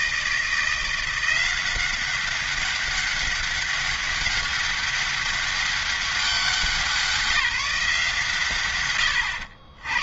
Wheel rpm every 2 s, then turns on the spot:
170, 200, 200, 190, 100.
none